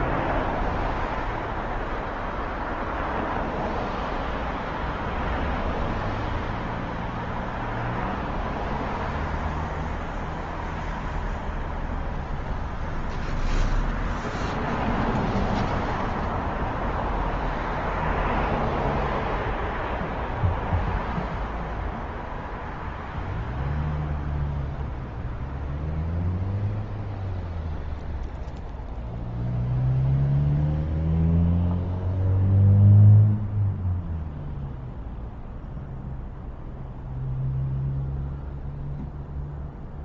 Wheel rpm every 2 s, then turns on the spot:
0, 0, 0, 0, 0, 0, 0, 0, 0, 0, 0, 0, 0, 0, 0, 0, 0, 0, 0, 0.
none